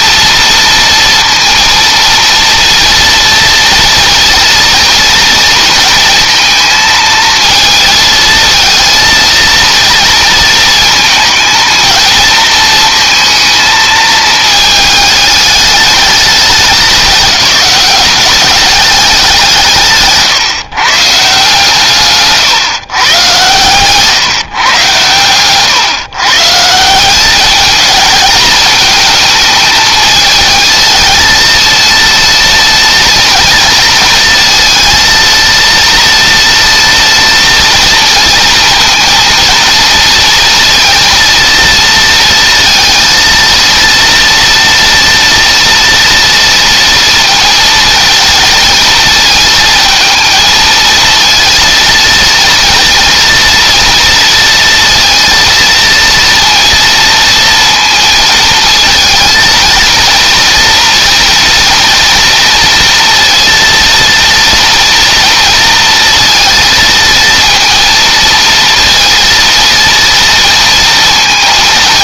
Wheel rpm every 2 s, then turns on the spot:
230, 230, 230, 220, 230, 230, 220, 210, 200, 190, 150, 120, 120, 180, 220, 230, 230, 230, 230, 230, 230, 230, 230, 230, 220, 230, 230, 230, 230, 230, 230, 230, 230, 220, 230, 230.
none